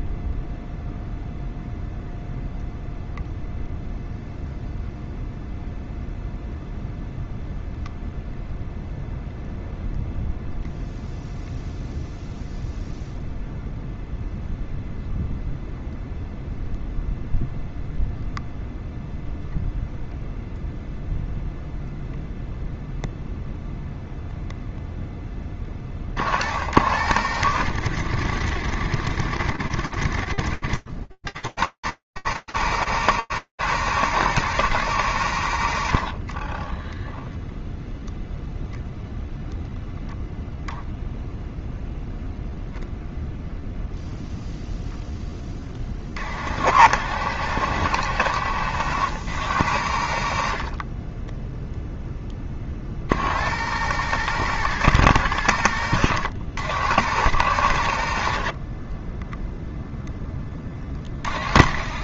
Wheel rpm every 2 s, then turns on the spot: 0, 0, 0, 0, 0, 0, 0, 0, 0, 0, 0, 0, 0, 60, 80, 60, 110, 110, 30, 0, 0, 0, 10, 70, 80, 0, 90, 100, 100, 0, 30.
36-38